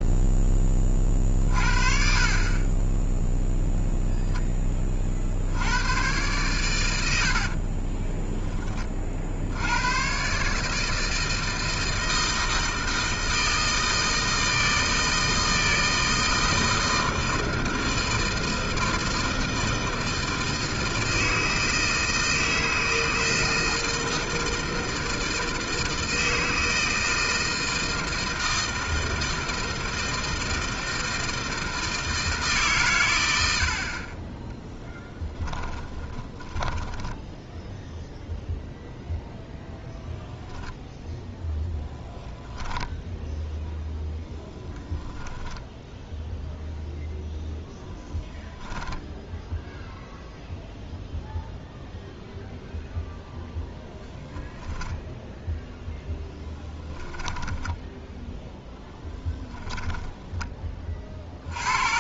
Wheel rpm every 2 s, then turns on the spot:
20, 20, 20, 110, 20, 140, 160, 160, 160, 160, 160, 160, 160, 160, 160, 160, 150, 10, 10, 0, 0, 10, 10, 0, 10, 0, 0, 0, 10, 0, 20.
36-38 42-46 48-50